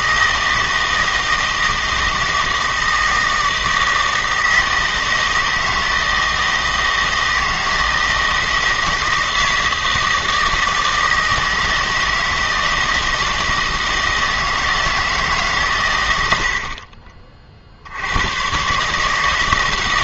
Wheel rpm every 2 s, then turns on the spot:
160, 160, 160, 160, 160, 160, 160, 160, 50, 140.
none